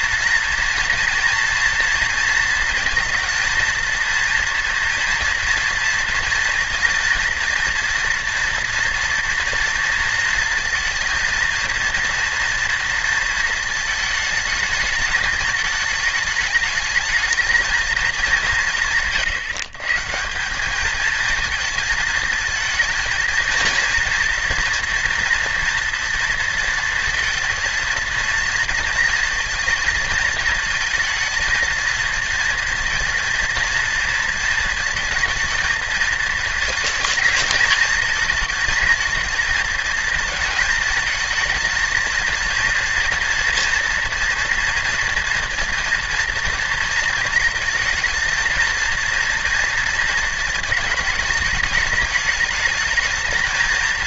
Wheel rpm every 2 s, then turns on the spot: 230, 230, 230, 230, 230, 230, 230, 220, 210, 150, 210, 220, 240, 230, 230, 230, 230, 230, 220, 230, 220, 230, 230, 230, 230, 220, 220.
none